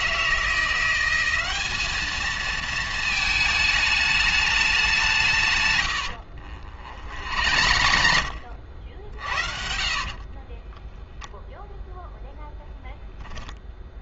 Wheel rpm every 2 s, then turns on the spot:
170, 220, 200, 50, 60, 30, 0.
6-8 10-12